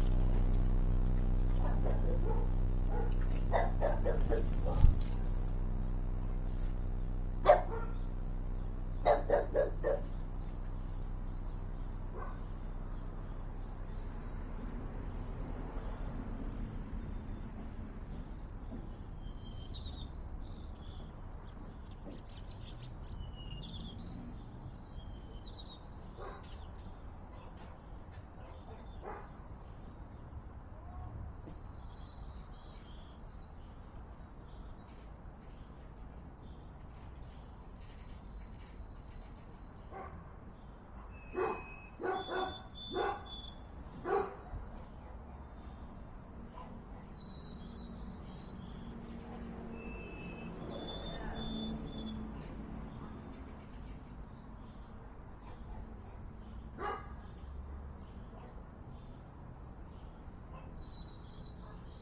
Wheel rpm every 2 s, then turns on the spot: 0, 0, 0, 0, 0, 0, 0, 0, 0, 0, 0, 0, 0, 0, 0, 0, 0, 0, 0, 0, 0, 0, 0, 0, 0, 0, 0, 0, 0, 0, 0.
none